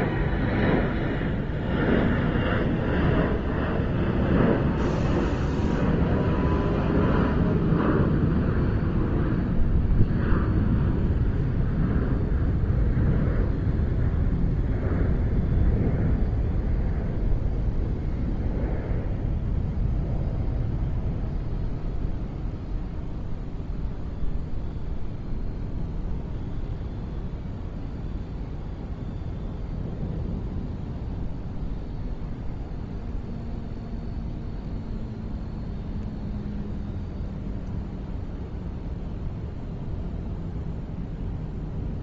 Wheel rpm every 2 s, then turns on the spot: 0, 0, 0, 0, 0, 0, 0, 0, 0, 0, 0, 0, 0, 0, 0, 0, 0, 0, 0, 0, 0.
none